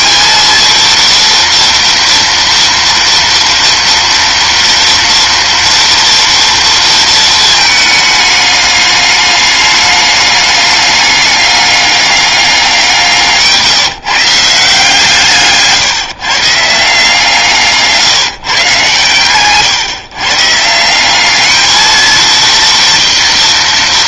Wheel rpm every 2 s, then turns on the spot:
230, 230, 230, 230, 210, 210, 190, 160, 150, 140, 150, 230.
none